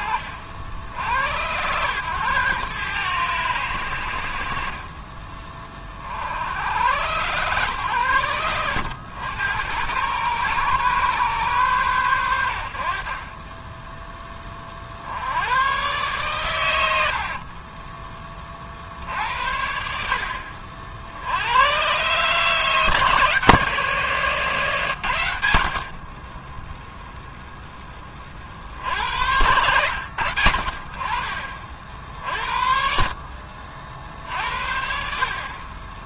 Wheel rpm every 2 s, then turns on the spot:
80, 110, 30, 100, 100, 130, 50, 70, 70, 60, 60, 160, 130, 0, 70, 40, 50, 60.
none